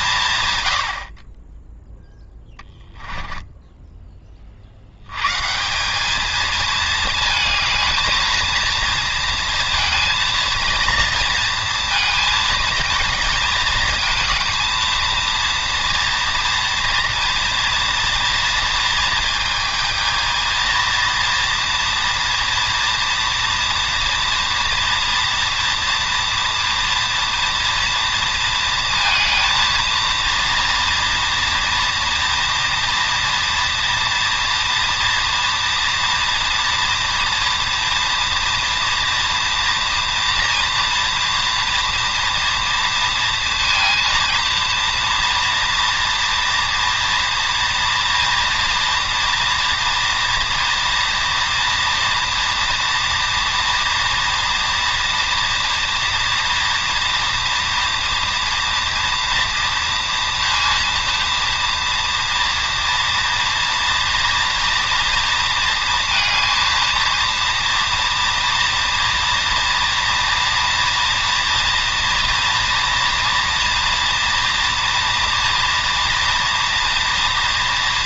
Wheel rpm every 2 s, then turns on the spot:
40, 10, 100, 220, 230, 230, 230, 230, 240, 230, 230, 230, 230, 230, 230, 230, 240, 230, 230, 240, 240, 230, 230, 240, 240, 240, 230, 230, 230, 230, 230, 230, 230, 230, 230, 230, 230, 230, 230.
2-4